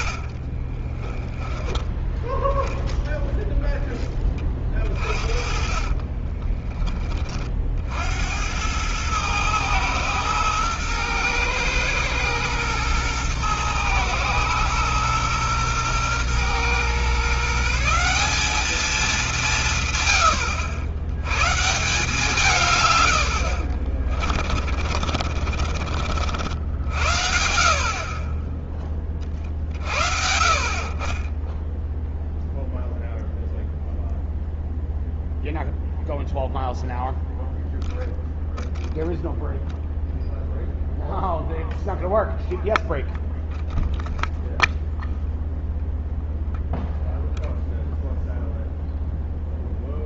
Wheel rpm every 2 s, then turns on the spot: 30, 10, 30, 20, 100, 120, 110, 120, 120, 200, 90, 140, 60, 60, 20, 50, 0, 0, 0, 0, 0, 0, 0, 0, 0.
0-2 22-26